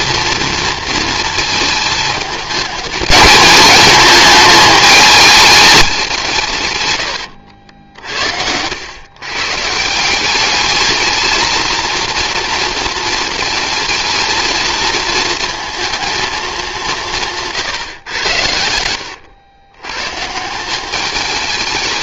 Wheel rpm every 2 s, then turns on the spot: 230, 210, 210, 110, 100, 210, 230, 220, 180, 90, 200.
18-20